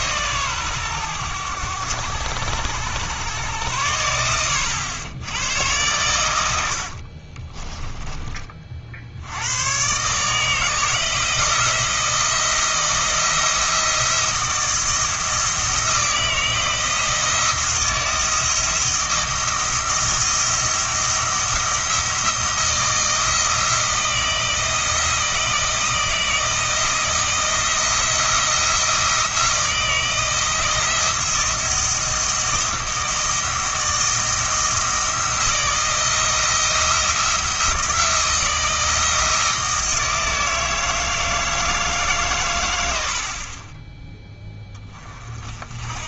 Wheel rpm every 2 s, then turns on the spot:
120, 90, 90, 80, 40, 160, 170, 170, 160, 170, 170, 170, 170, 160, 170, 160, 160, 160, 160, 170, 160, 100, 20.
6-8